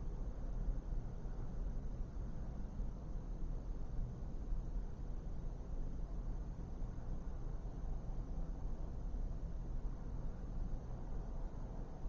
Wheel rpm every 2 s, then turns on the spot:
0, 0, 0, 0, 0, 0.
none